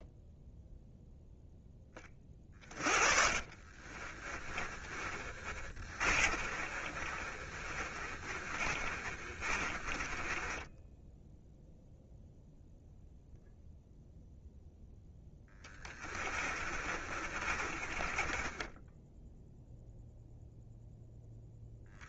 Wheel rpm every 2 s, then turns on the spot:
0, 30, 30, 30, 40, 10, 0, 0, 40, 10, 0.
2-12 16-20